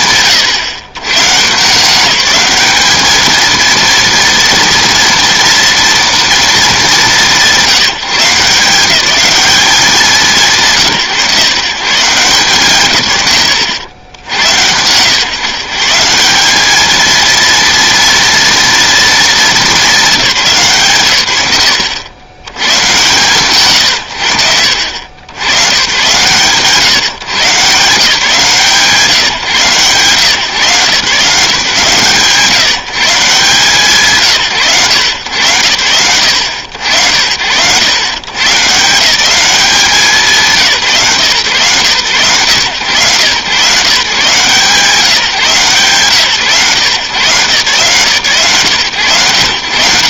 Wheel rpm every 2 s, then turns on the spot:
140, 220, 230, 190, 190, 140, 100, 110, 230, 220, 100, 120, 70, 130, 150, 130, 150, 110, 70, 160, 140, 120, 160, 130, 130.
none